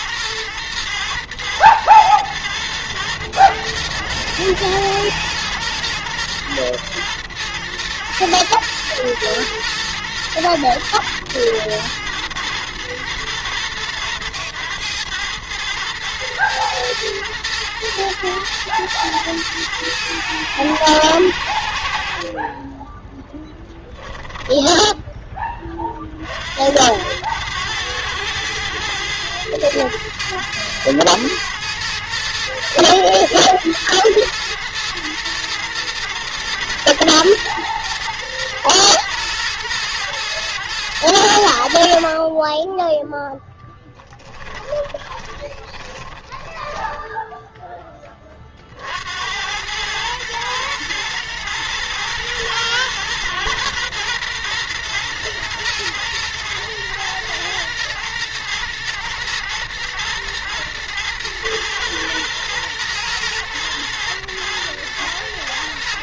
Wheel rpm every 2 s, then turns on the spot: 110, 120, 110, 110, 120, 120, 110, 110, 110, 110, 100, 30, 0, 70, 100, 110, 110, 110, 120, 110, 110, 30, 20, 20, 40, 110, 110, 120, 110, 120, 120, 110, 110.
44-48